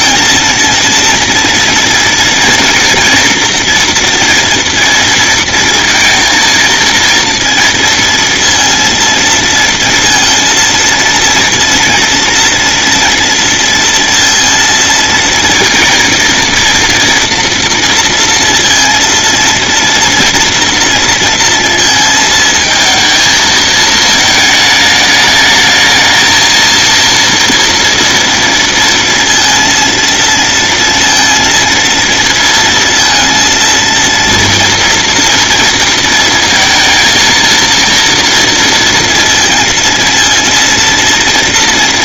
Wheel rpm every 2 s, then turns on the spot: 230, 230, 230, 230, 230, 230, 230, 230, 230, 230, 230, 220, 210, 230, 230, 230, 230, 230, 230, 230, 230.
none